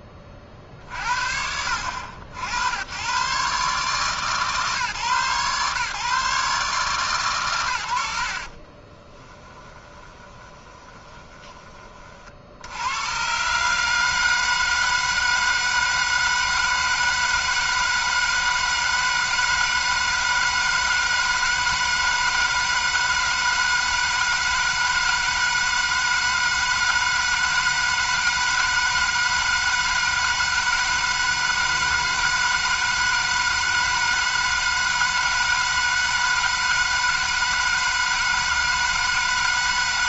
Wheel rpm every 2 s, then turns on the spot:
60, 100, 140, 140, 30, 20, 100, 160, 160, 160, 160, 160, 160, 160, 160, 160, 160, 160, 160, 160.
8-12